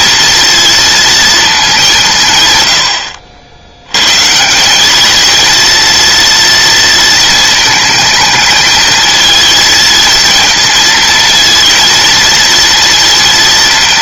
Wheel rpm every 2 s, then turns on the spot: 230, 90, 190, 230, 220, 230, 230.
none